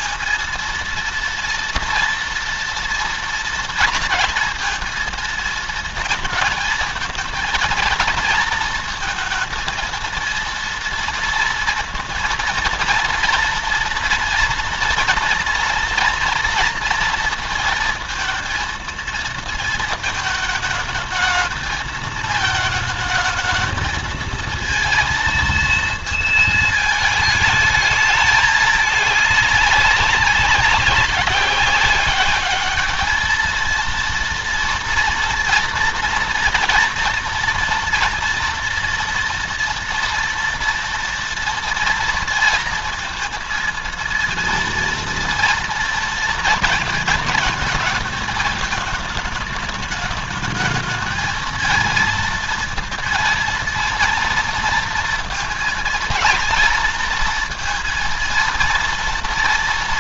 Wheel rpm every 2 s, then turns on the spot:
240, 230, 230, 220, 230, 230, 230, 230, 230, 230, 220, 220, 230, 220, 210, 190, 210, 230, 230, 230, 230, 230, 230, 230, 220, 220, 230, 230, 230, 230.
none